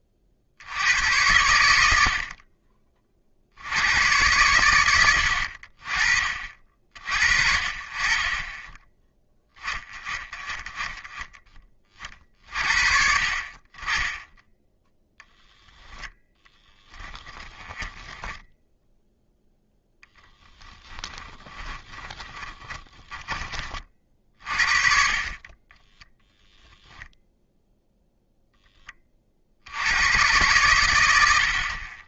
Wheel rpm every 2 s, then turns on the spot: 70, 30, 100, 50, 10, 20, 40, 20, 20, 0, 10, 10, 40, 0, 10, 110.
16-18 20-24